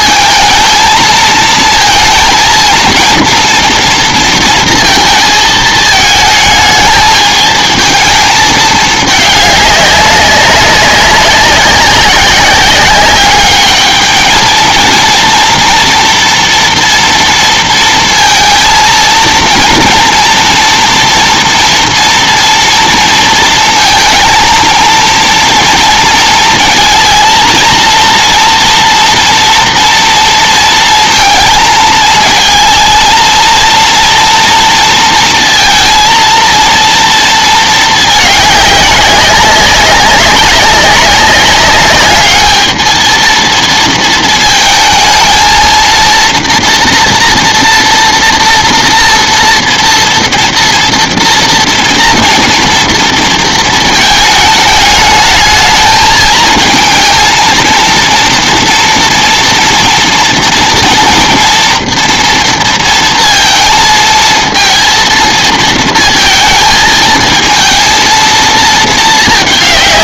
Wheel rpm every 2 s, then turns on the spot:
220, 220, 230, 220, 220, 190, 190, 220, 230, 230, 230, 230, 230, 230, 230, 230, 220, 230, 230, 200, 200, 220, 220, 230, 230, 230, 230, 220, 220, 230, 230, 230, 230, 220, 230.
none